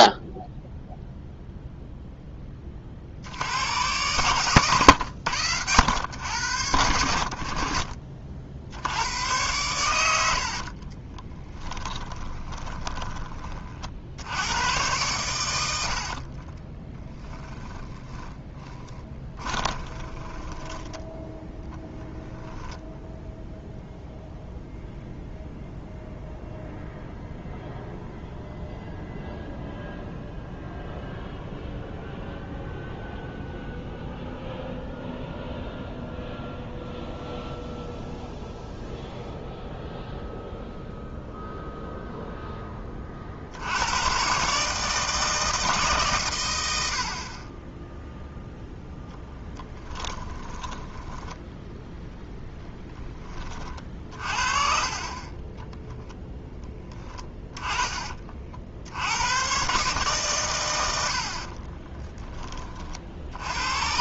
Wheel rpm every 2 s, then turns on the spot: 0, 30, 110, 80, 90, 30, 20, 100, 20, 20, 10, 0, 0, 0, 0, 0, 0, 0, 0, 0, 0, 30, 150, 90, 0, 10, 10, 40, 10, 60, 90, 50.
10-14 16-22 50-52 56-58